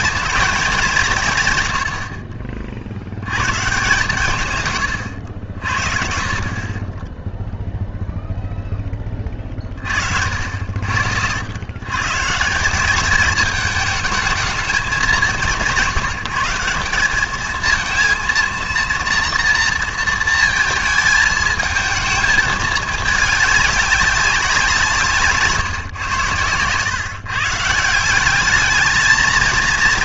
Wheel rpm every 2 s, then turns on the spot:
220, 60, 130, 40, 0, 60, 180, 210, 180, 230, 220, 210, 180, 110, 210.
none